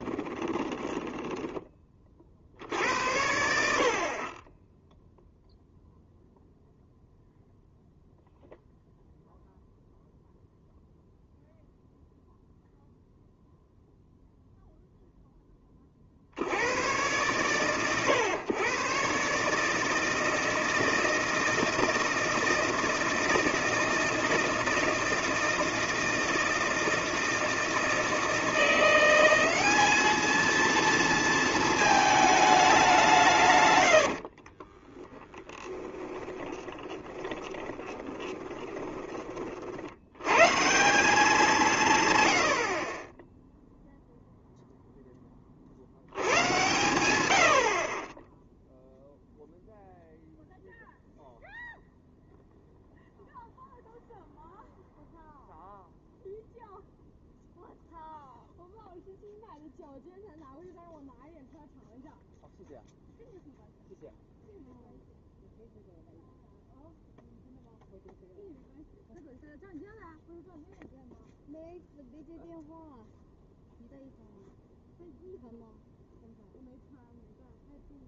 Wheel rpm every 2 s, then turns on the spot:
20, 60, 20, 0, 0, 0, 0, 0, 50, 120, 160, 160, 160, 160, 170, 220, 210, 40, 20, 20, 150, 70, 0, 110, 0, 0, 0, 0, 0, 0, 0, 0, 0, 0, 0, 0, 0, 0, 0.
0-2 34-40